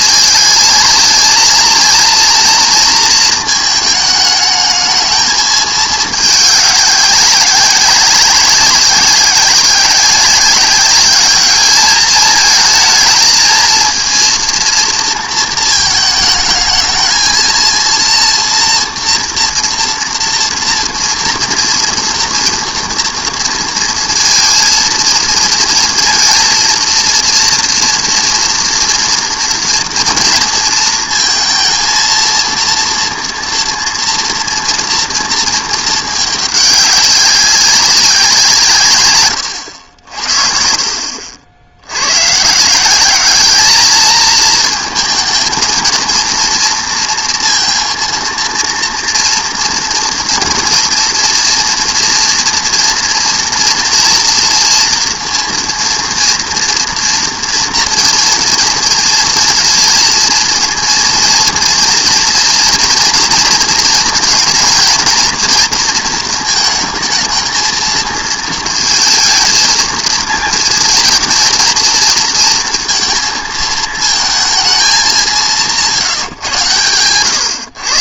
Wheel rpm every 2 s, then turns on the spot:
220, 230, 210, 200, 190, 200, 220, 230, 220, 230, 240, 230, 230, 230, 240, 230, 230, 230, 200, 160, 60, 150, 220, 230, 230, 230, 230, 230, 230, 230, 230, 230, 230, 220, 230, 220, 230, 220, 130.
none